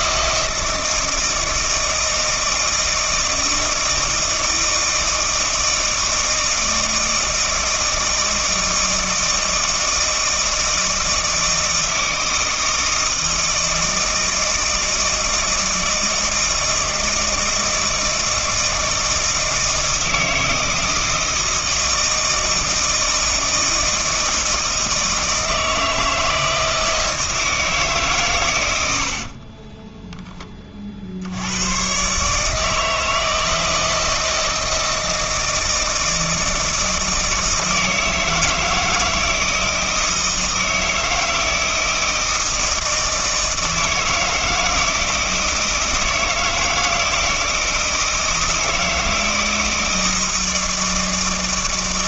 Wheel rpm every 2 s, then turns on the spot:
160, 160, 160, 160, 160, 160, 160, 160, 160, 160, 160, 160, 160, 160, 100, 40, 160, 160, 160, 160, 160, 160, 160, 160, 160, 160.
none